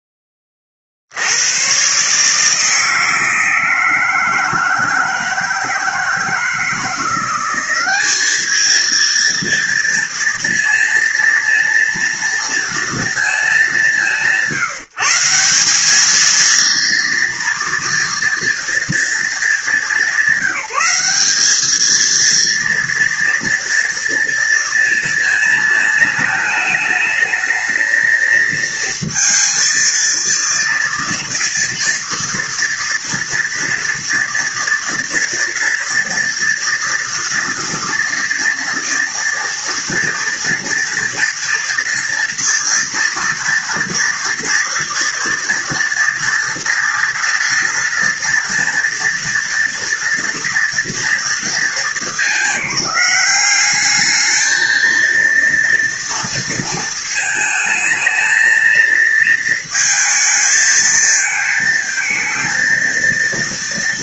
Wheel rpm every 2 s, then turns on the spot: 30, 150, 160, 160, 220, 230, 230, 180, 230, 230, 200, 230, 230, 210, 220, 230, 230, 230, 230, 230, 230, 240, 230, 230, 230, 240, 210, 220, 230, 220, 220, 230.
none